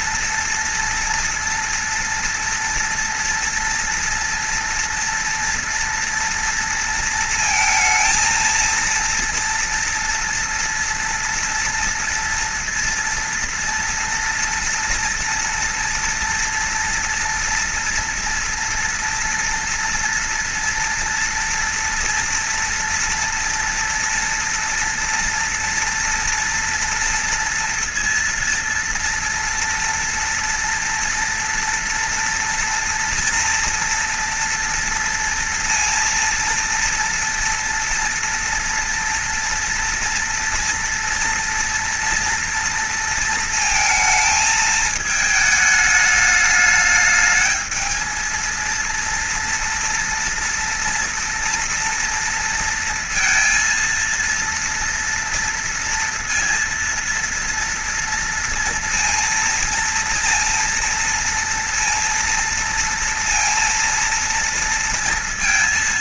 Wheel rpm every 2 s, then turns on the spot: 230, 230, 230, 230, 230, 240, 230, 230, 230, 230, 230, 230, 240, 230, 240, 230, 230, 230, 230, 230, 230, 230, 220, 210, 230, 230, 230, 230, 230, 230, 230, 230, 230.
none